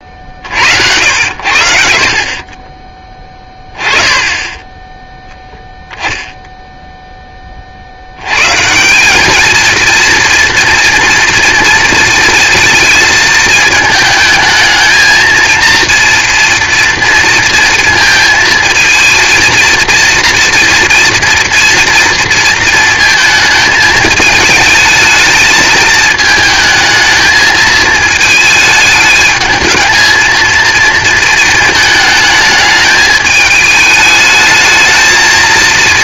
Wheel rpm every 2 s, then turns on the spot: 70, 20, 10, 0, 160, 230, 230, 220, 230, 230, 230, 230, 220, 220, 220, 230, 220, 220.
none